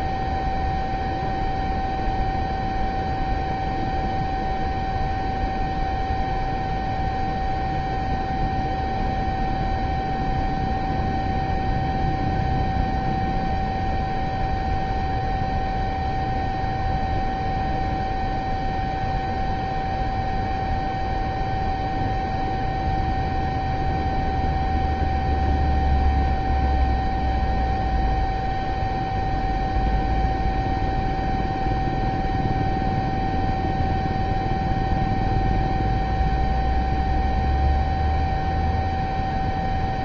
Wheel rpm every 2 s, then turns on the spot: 0, 0, 0, 0, 0, 0, 0, 0, 0, 0, 0, 0, 0, 0, 0, 0, 0, 0, 0, 0.
none